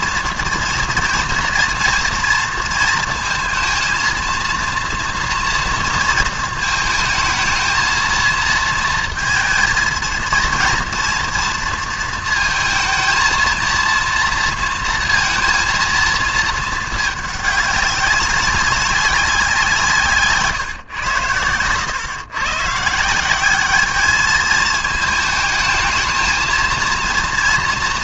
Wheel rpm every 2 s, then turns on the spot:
240, 230, 230, 220, 220, 230, 230, 230, 220, 190, 120, 160, 220, 230.
none